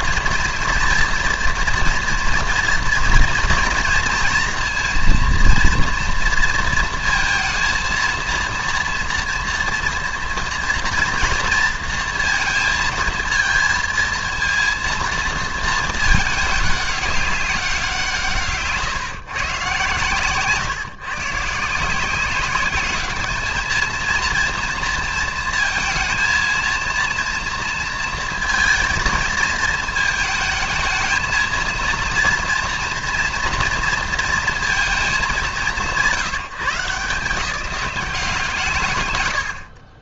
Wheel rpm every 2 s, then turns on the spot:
230, 230, 230, 230, 230, 230, 230, 230, 210, 150, 140, 210, 230, 230, 230, 220, 230, 230, 180, 150.
none